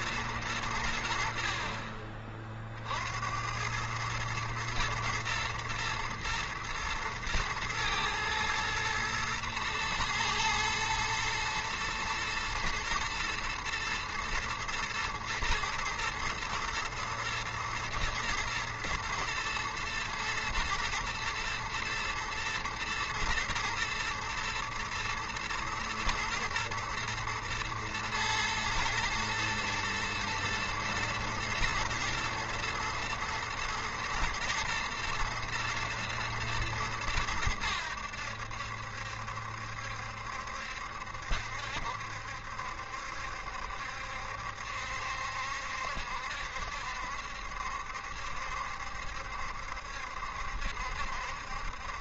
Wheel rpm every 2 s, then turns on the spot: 80, 60, 110, 110, 110, 110, 120, 120, 110, 110, 110, 120, 110, 110, 120, 120, 120, 110, 110, 70, 70, 70, 70, 70, 70, 70.
none